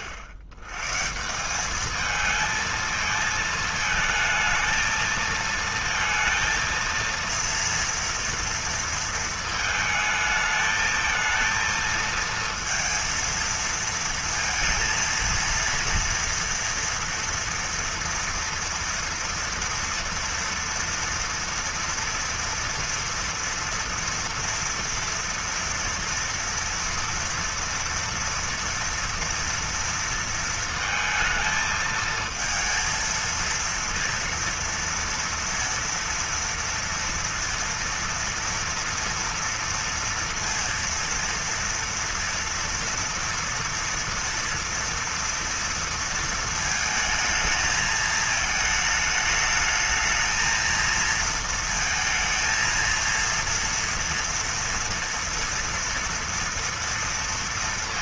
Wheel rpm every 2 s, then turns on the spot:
100, 220, 220, 230, 230, 220, 230, 230, 230, 230, 230, 230, 230, 240, 230, 230, 220, 230, 230, 230, 230, 230, 230, 220, 220, 220, 230, 230, 230.
none